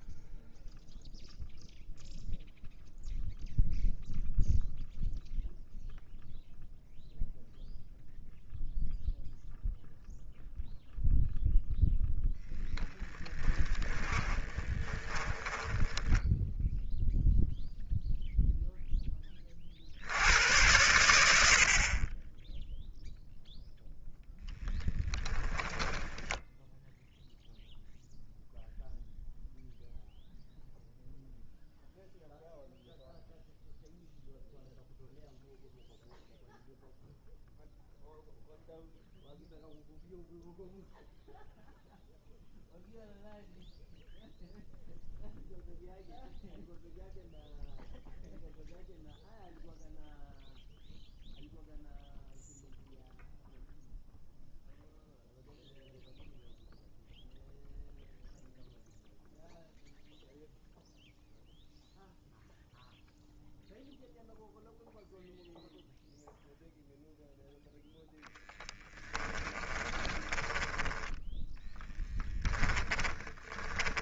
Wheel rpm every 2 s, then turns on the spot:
0, 0, 0, 0, 0, 0, 10, 20, 0, 0, 100, 0, 10, 0, 0, 0, 0, 0, 0, 0, 0, 0, 0, 0, 0, 0, 0, 0, 0, 0, 0, 0, 0, 0, 10, 10, 10.
12-16 24-26 68-74